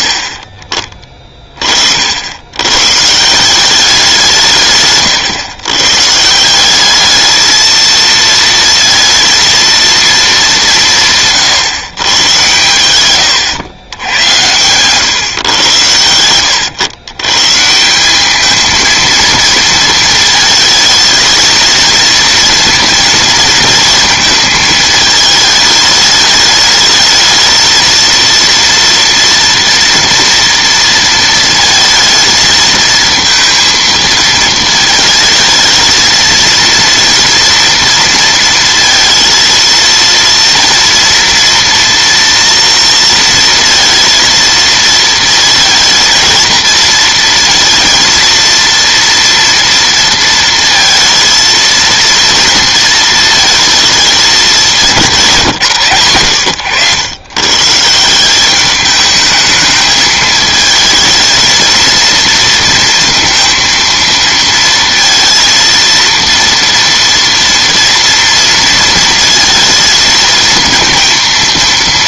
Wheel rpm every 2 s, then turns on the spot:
40, 120, 140, 200, 230, 170, 110, 120, 100, 220, 220, 230, 220, 210, 230, 230, 220, 220, 230, 230, 230, 230, 230, 220, 230, 230, 230, 190, 110, 210, 220, 230, 230, 230, 230, 230.
14-16